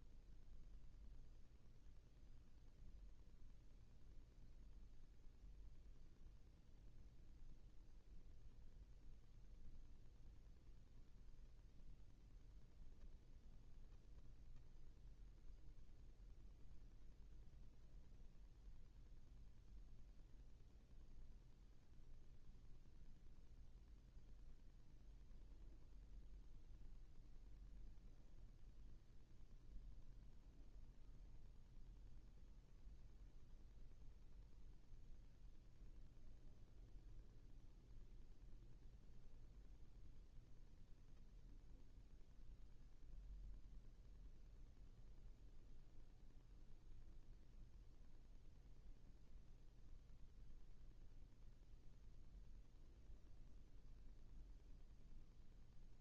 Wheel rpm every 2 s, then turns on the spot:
0, 0, 0, 0, 0, 0, 0, 0, 0, 0, 0, 0, 0, 0, 0, 0, 0, 0, 0, 0, 0, 0, 0, 0, 0, 0, 0, 0.
none